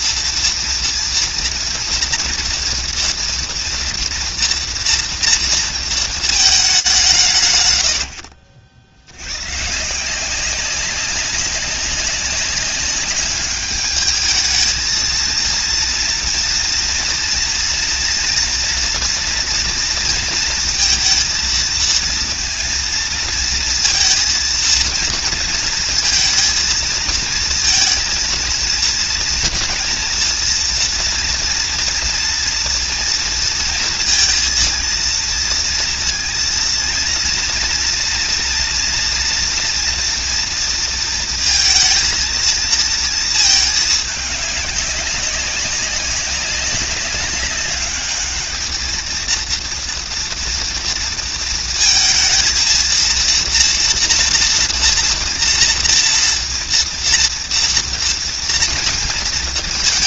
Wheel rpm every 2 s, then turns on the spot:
230, 230, 230, 150, 80, 190, 200, 220, 230, 240, 230, 230, 230, 230, 230, 230, 230, 230, 230, 230, 230, 230, 200, 200, 220, 230, 230, 230, 230, 220.
none